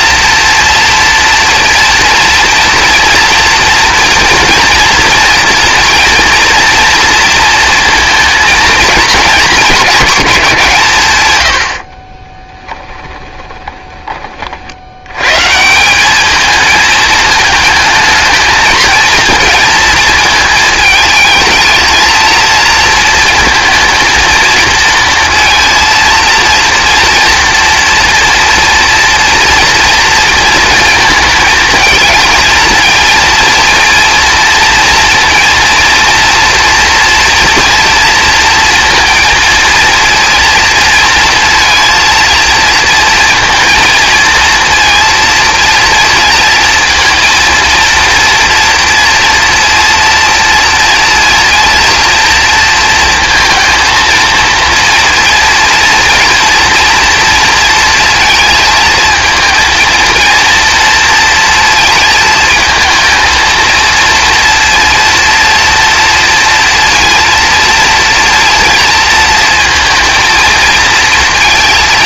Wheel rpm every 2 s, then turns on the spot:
240, 230, 230, 230, 230, 150, 10, 70, 220, 220, 220, 230, 230, 230, 240, 220, 230, 230, 230, 230, 230, 230, 230, 230, 230, 230, 230, 230, 230, 230, 230, 230, 230, 230, 230, 230.
12-14